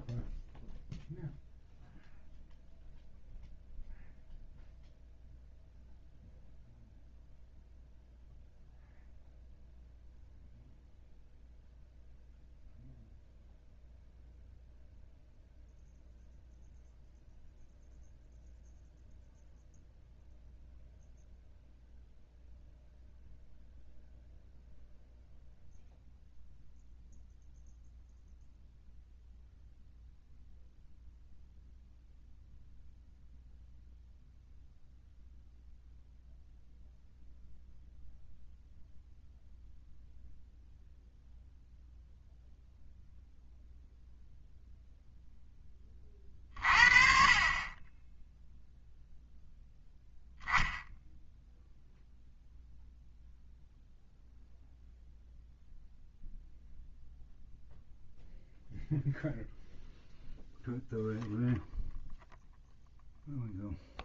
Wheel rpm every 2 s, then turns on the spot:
0, 0, 0, 0, 0, 0, 0, 0, 0, 0, 0, 0, 0, 0, 0, 0, 0, 0, 0, 0, 0, 0, 0, 40, 0, 10, 0, 0, 0, 0, 0, 0.
none